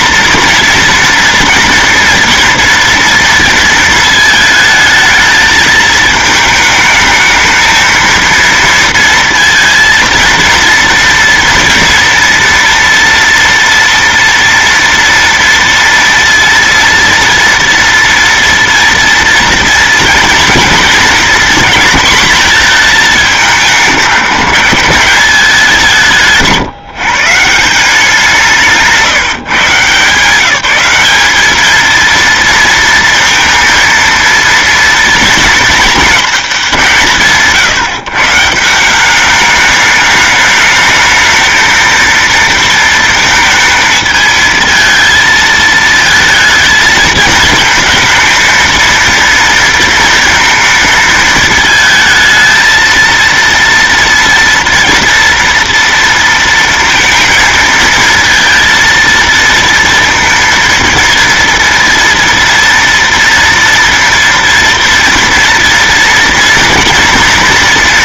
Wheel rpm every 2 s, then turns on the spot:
230, 230, 220, 220, 230, 230, 230, 230, 230, 230, 230, 220, 170, 150, 160, 200, 230, 230, 190, 170, 220, 230, 220, 220, 230, 220, 230, 240, 230, 230, 230, 230, 230, 230.
none